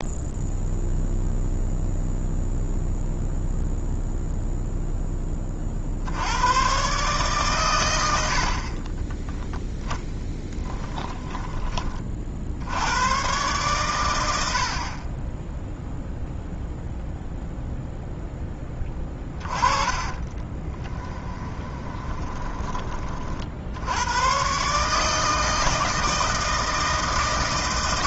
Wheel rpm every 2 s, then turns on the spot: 0, 0, 0, 120, 40, 10, 80, 50, 0, 10, 20, 20, 140, 160.
10-12 20-22